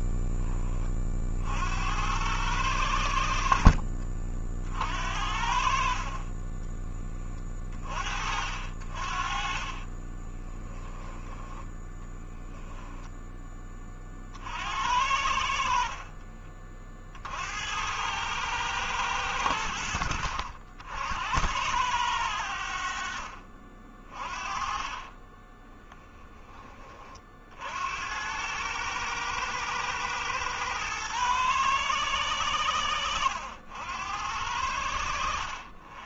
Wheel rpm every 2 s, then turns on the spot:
10, 90, 50, 20, 50, 20, 10, 60, 50, 110, 70, 70, 30, 30, 110, 110, 90, 70.
6-8 10-12 22-24